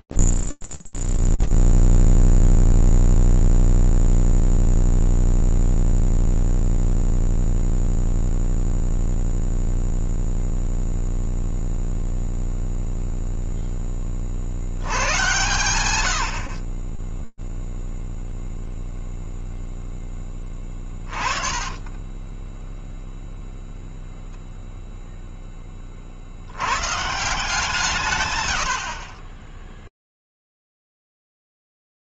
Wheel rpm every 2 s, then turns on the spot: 0, 0, 0, 0, 0, 0, 0, 70, 60, 0, 20, 0, 0, 120, 60, 0.
20-22